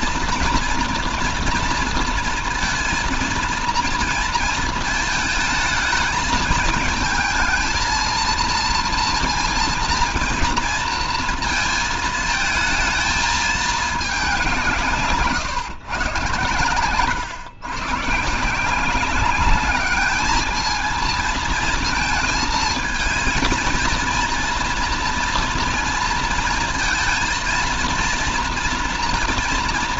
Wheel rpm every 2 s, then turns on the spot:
230, 230, 220, 220, 230, 230, 220, 160, 120, 180, 220, 220, 230, 230, 230.
none